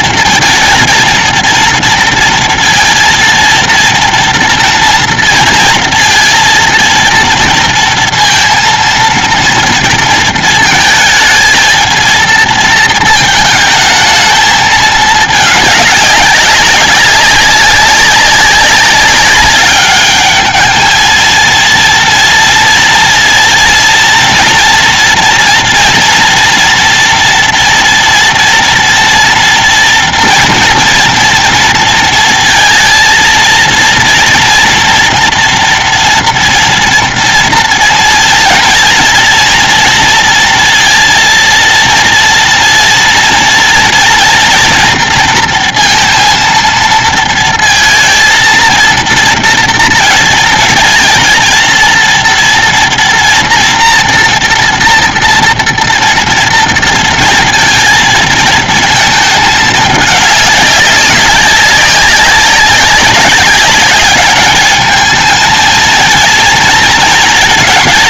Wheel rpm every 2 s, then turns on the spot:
230, 230, 230, 230, 230, 220, 220, 210, 200, 200, 220, 230, 240, 230, 240, 240, 230, 230, 230, 240, 230, 230, 230, 230, 230, 220, 240, 230, 230, 220, 200, 200, 220, 230.
none